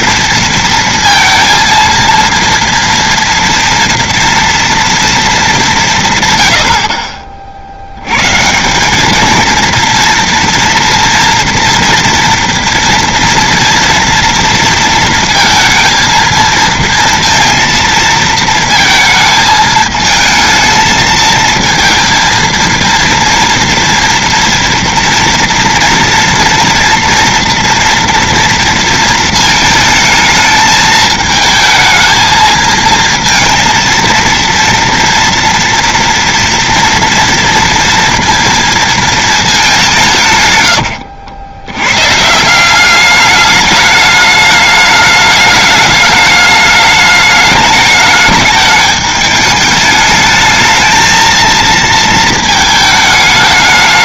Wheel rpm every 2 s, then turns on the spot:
230, 230, 230, 150, 110, 230, 230, 230, 220, 230, 220, 230, 230, 240, 230, 220, 220, 230, 230, 230, 160, 120, 210, 210, 210, 210, 220.
none